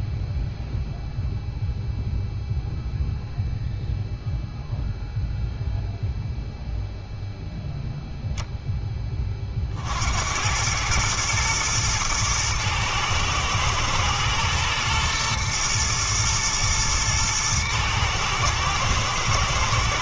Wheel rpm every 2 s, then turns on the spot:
0, 0, 0, 0, 10, 100, 110, 120, 110, 110.
none